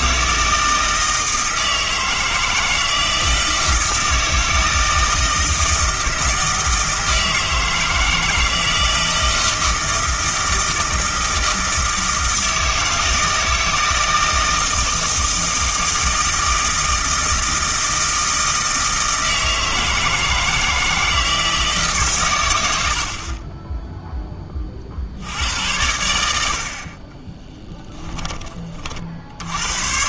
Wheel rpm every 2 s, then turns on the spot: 160, 160, 160, 160, 160, 160, 160, 160, 160, 160, 160, 90, 40, 40, 50.
none